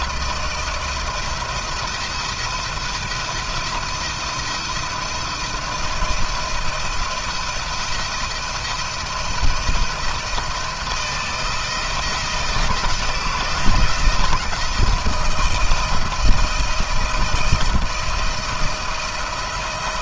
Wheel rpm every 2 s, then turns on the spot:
170, 170, 170, 170, 170, 170, 170, 160, 170, 170.
none